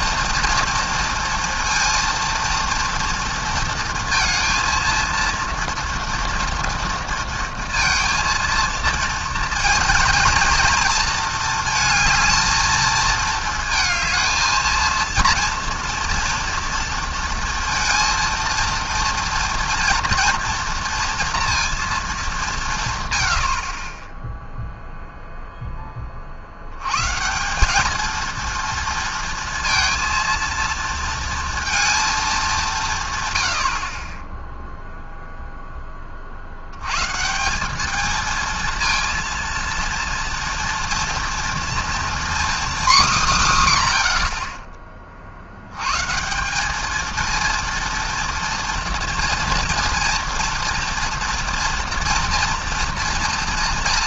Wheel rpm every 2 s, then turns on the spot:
230, 230, 230, 230, 230, 220, 220, 230, 230, 230, 230, 140, 0, 110, 230, 230, 160, 0, 90, 230, 230, 240, 30, 210, 230, 230, 240.
none